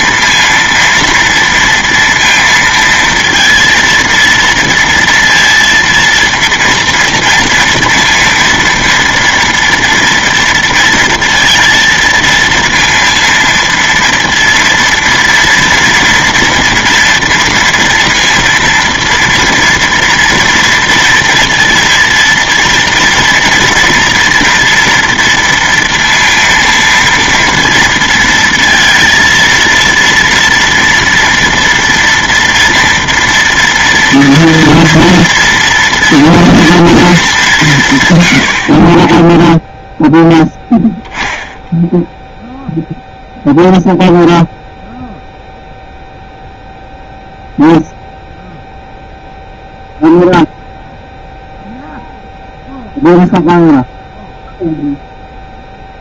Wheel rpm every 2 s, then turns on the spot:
230, 230, 230, 230, 230, 230, 230, 230, 230, 230, 230, 230, 230, 230, 230, 230, 230, 230, 230, 70, 10, 0, 0, 0, 0, 0, 0, 0.
none